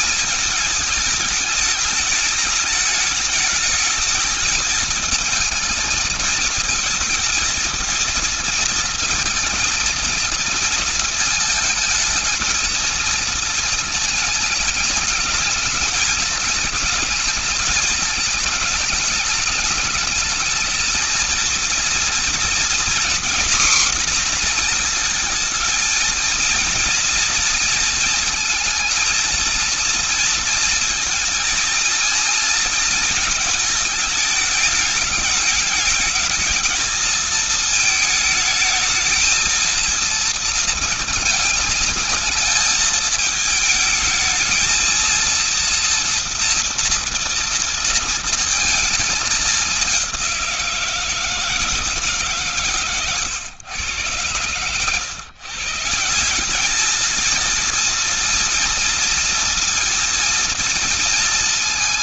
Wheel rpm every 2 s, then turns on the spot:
220, 210, 220, 220, 230, 230, 220, 220, 220, 220, 220, 230, 240, 230, 230, 230, 230, 210, 220, 220, 230, 220, 220, 230, 230, 190, 140, 100, 180, 230, 230.
none